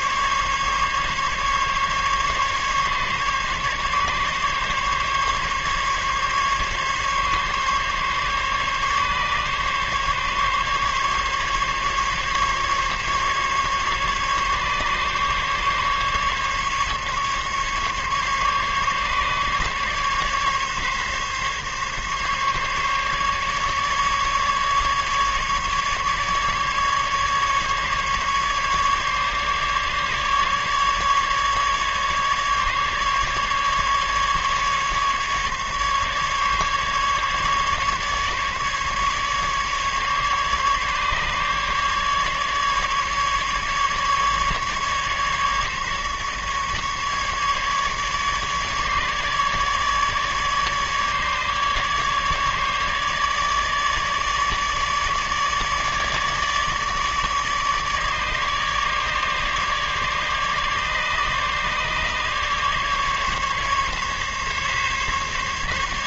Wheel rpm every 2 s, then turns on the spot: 140, 140, 140, 140, 140, 140, 140, 140, 140, 140, 140, 140, 140, 150, 140, 150, 150, 150, 140, 140, 140, 150, 150, 150, 150, 150, 150, 150, 150, 150, 150, 140, 140.
none